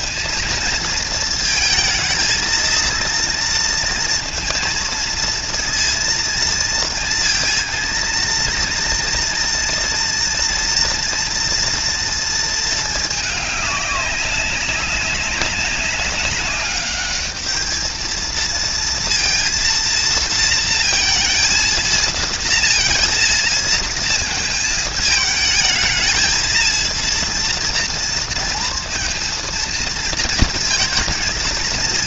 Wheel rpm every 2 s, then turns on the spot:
230, 230, 230, 230, 230, 230, 230, 200, 200, 230, 230, 230, 220, 220, 230, 230.
none